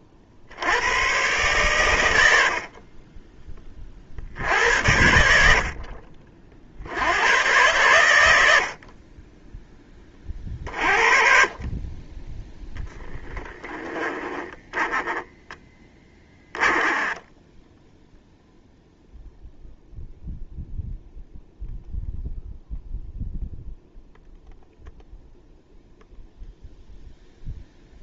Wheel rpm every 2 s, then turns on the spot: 90, 60, 70, 70, 70, 30, 0, 10, 20, 0, 0, 0, 0, 0.
16-18